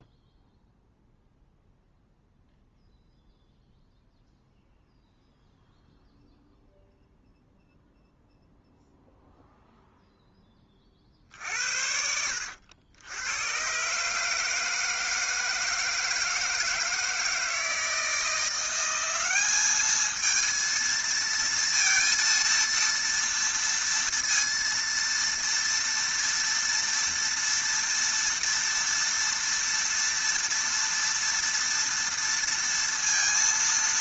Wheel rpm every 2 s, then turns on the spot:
0, 0, 0, 0, 0, 20, 90, 150, 160, 170, 230, 230, 230, 240, 230, 230, 230.
none